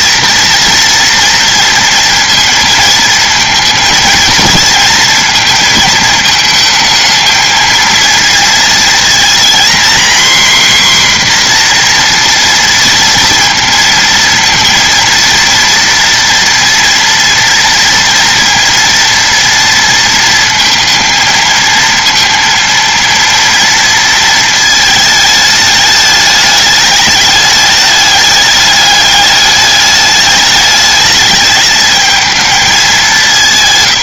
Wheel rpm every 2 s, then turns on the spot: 230, 230, 230, 220, 230, 260, 230, 230, 240, 230, 220, 230, 220, 200, 210, 210, 210.
none